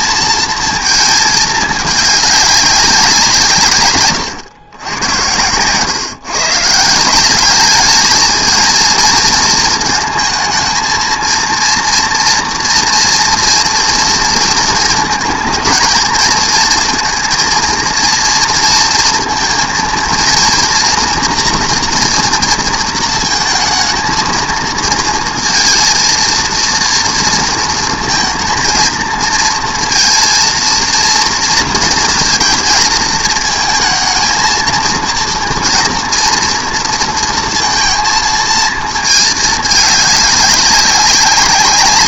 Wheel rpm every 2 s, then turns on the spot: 230, 200, 110, 150, 220, 220, 240, 220, 230, 230, 240, 230, 220, 230, 220, 230, 230, 220, 230, 220, 200.
none